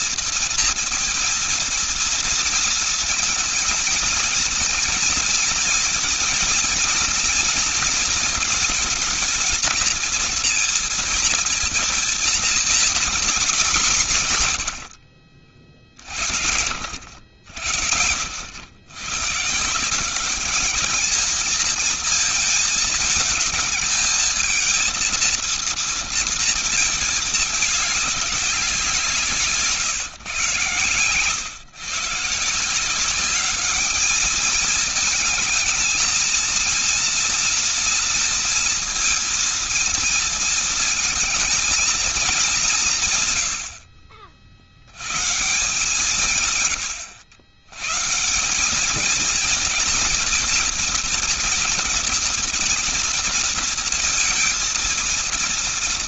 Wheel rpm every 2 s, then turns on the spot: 230, 230, 230, 230, 220, 230, 230, 130, 90, 80, 200, 220, 220, 230, 190, 130, 160, 220, 230, 230, 220, 200, 60, 140, 180, 230, 230, 230.
none